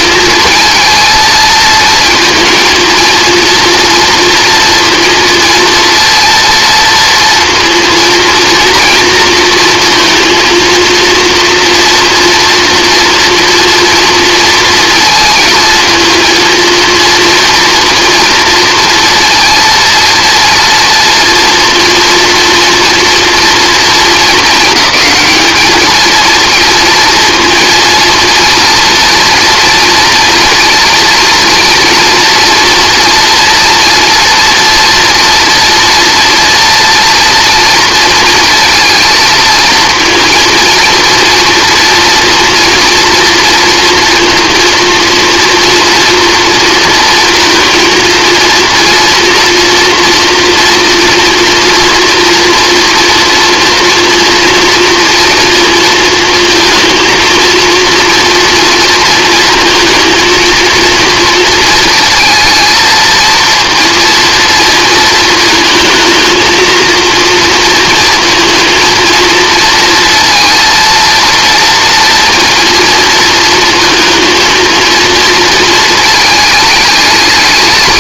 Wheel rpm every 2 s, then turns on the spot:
230, 230, 230, 230, 230, 230, 230, 230, 230, 230, 230, 230, 220, 230, 230, 230, 230, 240, 230, 230, 230, 240, 230, 240, 230, 230, 230, 230, 230, 230, 230, 220, 230, 230, 230, 230, 230, 230, 210.
none